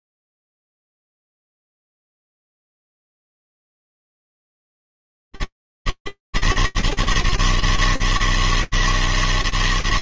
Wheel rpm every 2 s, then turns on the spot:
80, 160, 150, 160, 160.
none